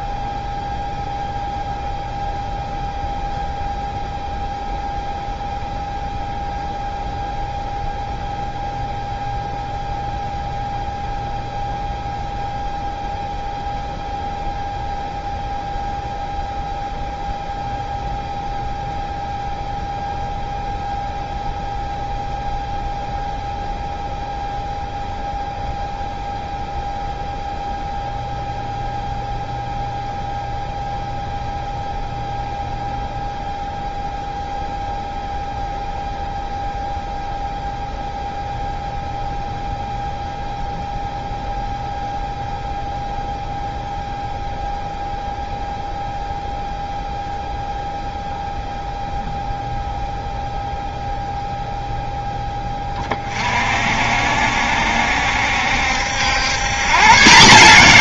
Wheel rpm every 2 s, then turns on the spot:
0, 0, 0, 0, 0, 0, 0, 0, 0, 0, 0, 0, 0, 0, 0, 0, 0, 0, 0, 0, 0, 0, 0, 0, 0, 0, 20, 70, 120.
none